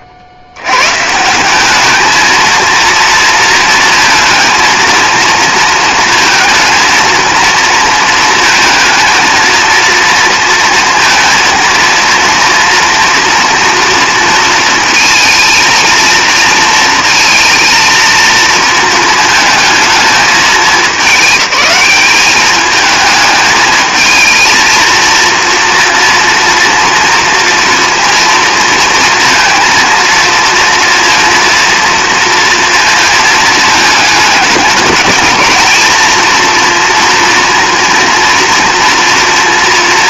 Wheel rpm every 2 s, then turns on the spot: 100, 230, 230, 230, 230, 230, 230, 230, 230, 220, 210, 210, 230, 230, 230, 230, 230, 220, 230, 230.
none